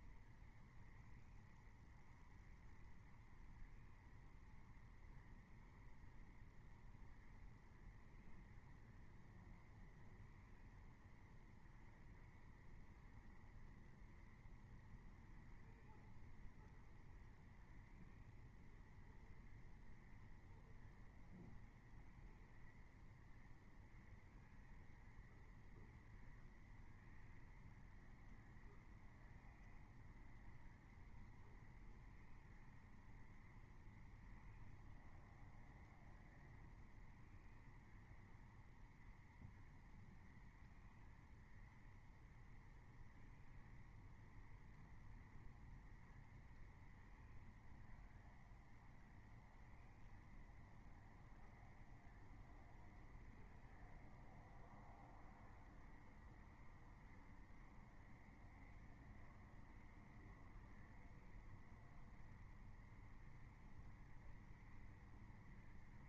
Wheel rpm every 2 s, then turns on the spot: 0, 0, 0, 0, 0, 0, 0, 0, 0, 0, 0, 0, 0, 0, 0, 0, 0, 0, 0, 0, 0, 0, 0, 0, 0, 0, 0, 0, 0, 0, 0, 0, 0.
none